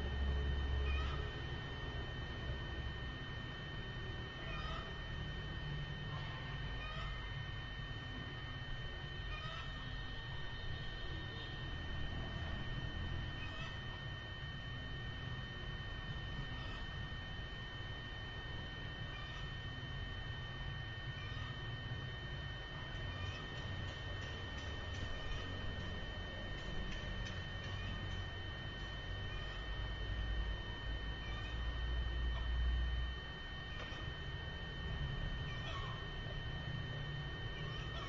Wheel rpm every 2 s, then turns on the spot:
0, 0, 0, 0, 0, 0, 0, 0, 0, 0, 0, 0, 0, 0, 0, 0, 0, 0, 0.
none